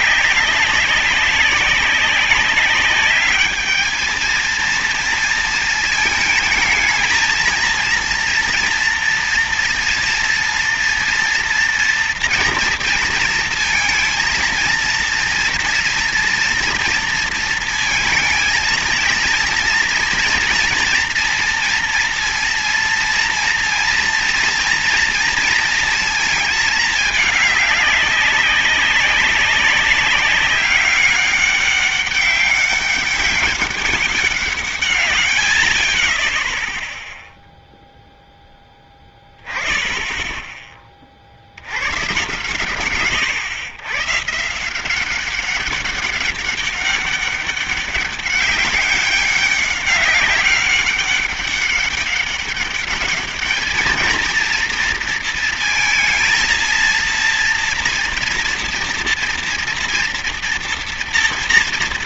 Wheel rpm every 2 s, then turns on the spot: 200, 190, 220, 220, 240, 230, 230, 230, 230, 230, 230, 230, 230, 220, 200, 200, 200, 160, 10, 0, 20, 130, 140, 200, 200, 200, 200, 230, 230, 230, 230.
none